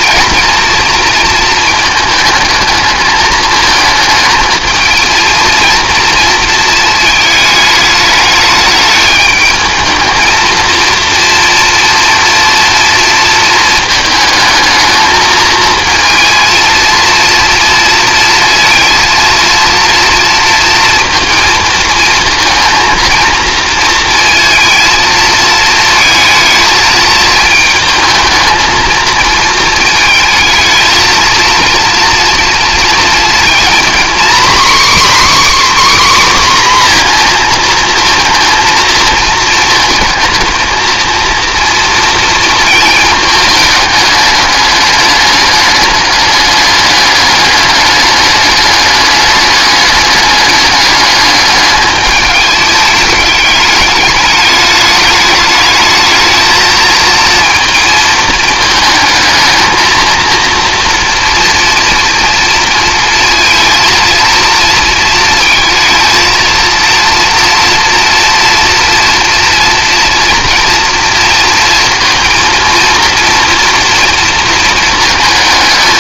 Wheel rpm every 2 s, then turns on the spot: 230, 220, 220, 220, 210, 230, 230, 220, 230, 230, 230, 230, 220, 220, 220, 220, 230, 270, 260, 230, 220, 230, 210, 210, 210, 200, 210, 210, 220, 220, 230, 230, 230, 230, 230, 230, 230, 230.
none